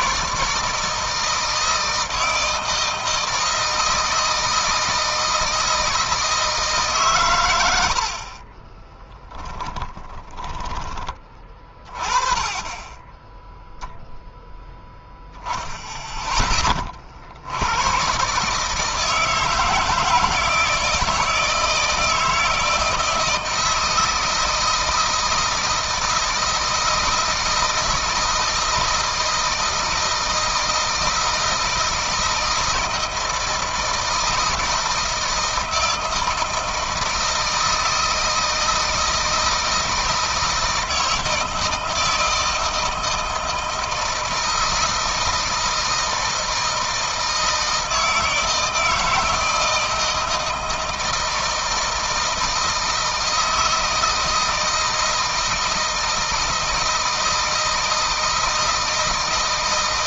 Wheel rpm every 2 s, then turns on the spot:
150, 160, 160, 150, 30, 20, 20, 10, 30, 150, 160, 160, 160, 160, 160, 160, 160, 160, 160, 160, 160, 160, 160, 160, 160, 160, 160, 160, 160, 160.
8-10